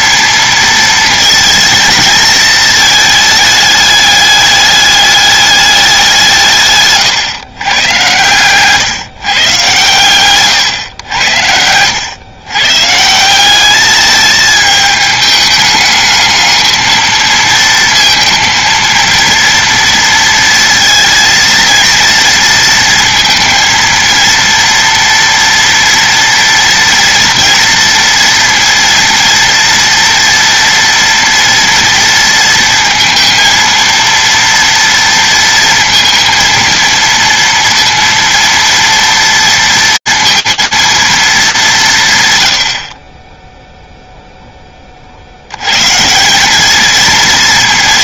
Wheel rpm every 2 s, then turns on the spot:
230, 220, 200, 140, 140, 110, 150, 210, 220, 230, 230, 230, 230, 230, 230, 230, 230, 230, 230, 230, 230, 50, 30, 220.
none